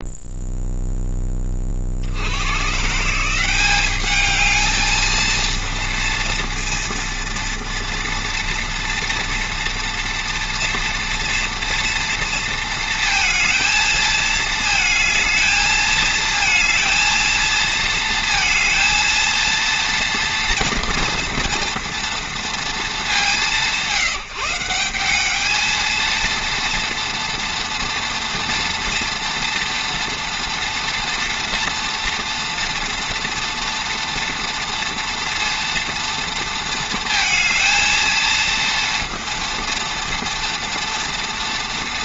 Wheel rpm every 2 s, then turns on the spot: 0, 100, 210, 230, 230, 230, 230, 220, 220, 230, 230, 230, 170, 230, 230, 230, 230, 230, 230, 230, 230.
none